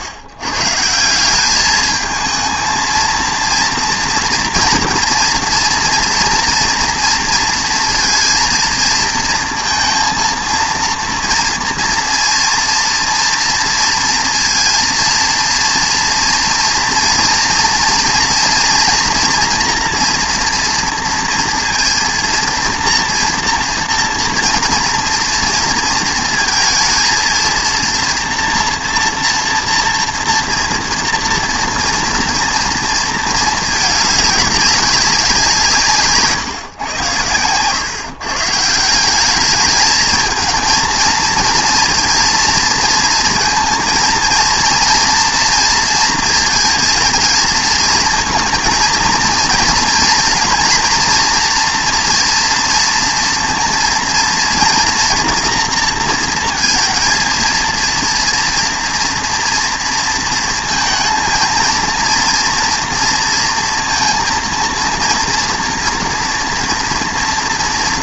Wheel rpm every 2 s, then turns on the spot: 120, 220, 230, 240, 230, 230, 230, 230, 230, 230, 230, 230, 230, 230, 230, 230, 230, 200, 130, 170, 230, 230, 230, 220, 230, 240, 230, 230, 230, 230, 220, 230, 230, 230.
none